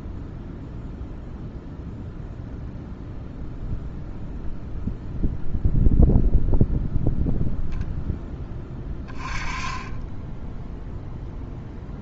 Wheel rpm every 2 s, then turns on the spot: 0, 0, 0, 0, 20, 0.
none